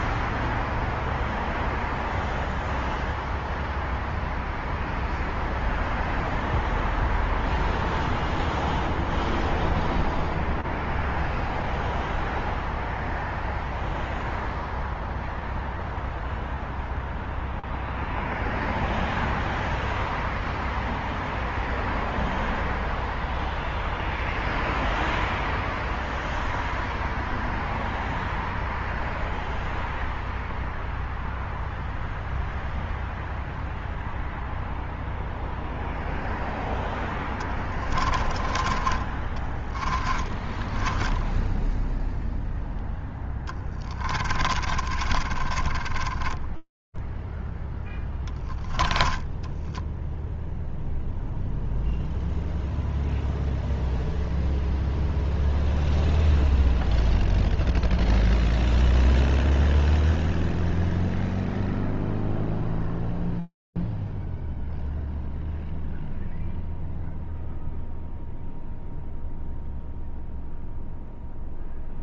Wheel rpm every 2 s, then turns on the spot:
0, 0, 0, 0, 0, 0, 0, 0, 0, 0, 0, 0, 0, 0, 0, 0, 0, 0, 0, 10, 20, 0, 10, 30, 0, 0, 0, 0, 0, 0, 0, 0, 0, 0, 0, 0.
38-42 44-48